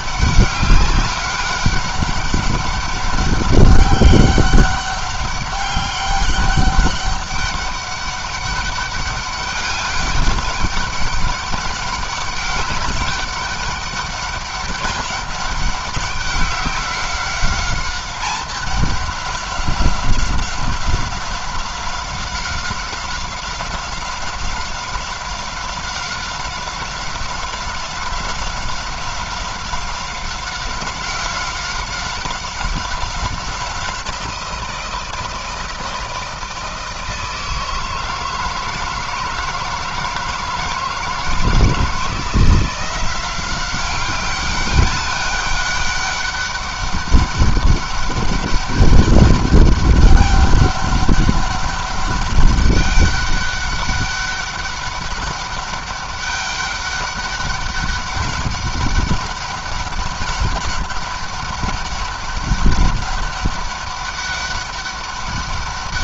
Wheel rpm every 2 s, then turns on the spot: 190, 200, 190, 200, 200, 200, 200, 200, 190, 200, 190, 190, 190, 190, 190, 190, 190, 170, 160, 160, 170, 180, 200, 200, 200, 200, 200, 200, 200, 200, 200, 200, 200.
none